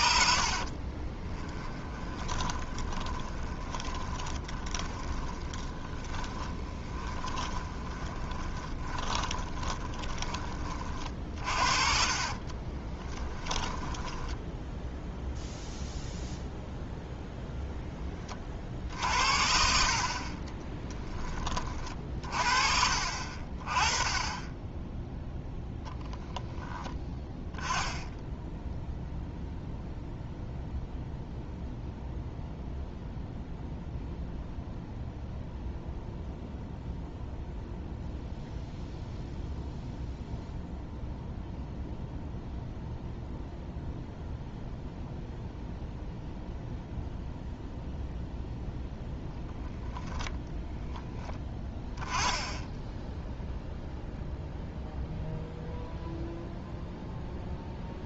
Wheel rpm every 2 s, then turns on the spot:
30, 20, 30, 20, 20, 30, 20, 0, 0, 50, 20, 50, 10, 10, 0, 0, 0, 0, 0, 0, 0, 0, 0, 0, 0, 10, 10, 0, 0.
0-14 20-22